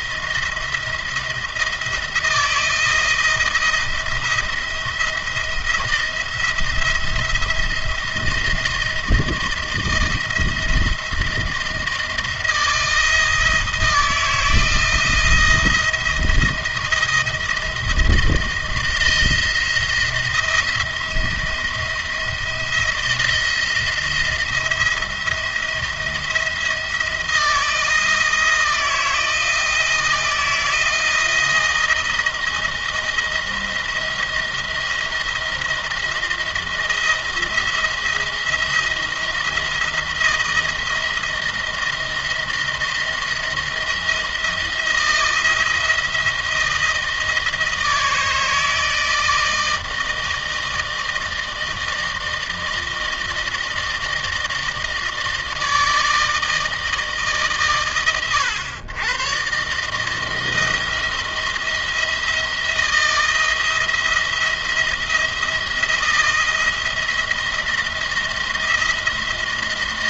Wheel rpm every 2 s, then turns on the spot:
170, 170, 170, 170, 170, 160, 170, 170, 170, 160, 170, 170, 170, 170, 170, 160, 170, 170, 170, 170, 170, 170, 170, 160, 160, 160, 160, 160, 160, 120, 160, 170, 170, 170, 170.
none